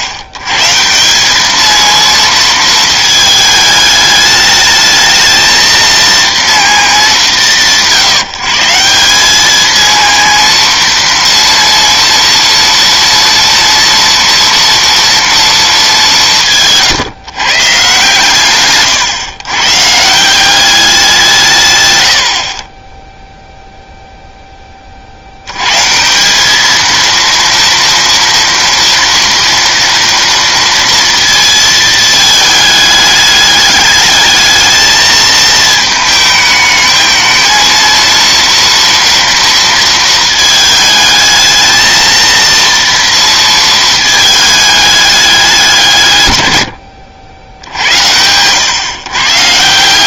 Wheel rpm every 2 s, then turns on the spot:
120, 220, 220, 210, 160, 230, 230, 230, 160, 130, 190, 30, 10, 210, 230, 230, 210, 220, 220, 230, 220, 230, 210, 110, 110.
none